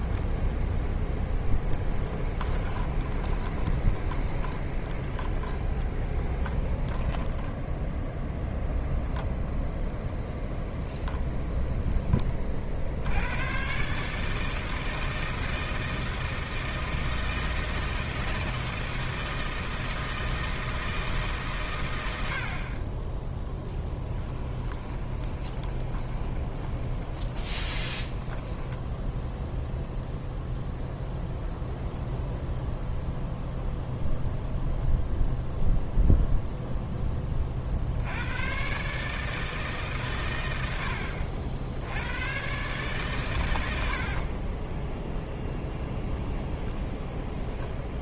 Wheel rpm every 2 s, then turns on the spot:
0, 20, 20, 10, 0, 0, 70, 160, 160, 160, 160, 20, 20, 20, 10, 0, 0, 0, 10, 140, 80, 130, 10, 10.
2-8 24-30 44-46